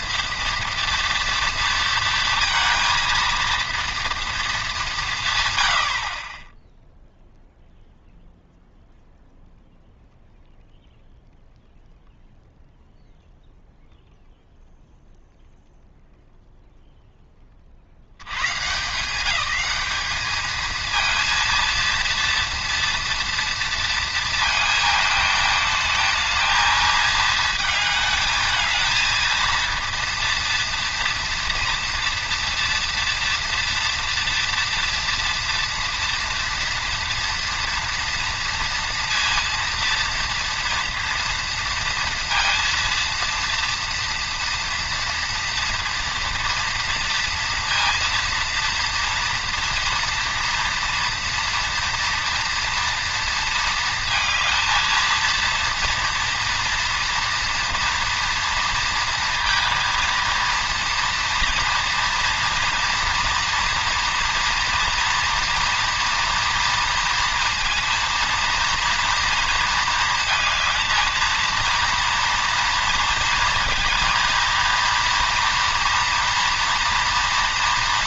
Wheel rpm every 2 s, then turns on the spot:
230, 230, 210, 10, 0, 0, 0, 0, 0, 150, 220, 230, 220, 220, 220, 230, 230, 230, 230, 230, 230, 230, 240, 240, 230, 230, 240, 230, 230, 230, 230, 230, 230, 230, 230, 220, 230, 230, 240.
none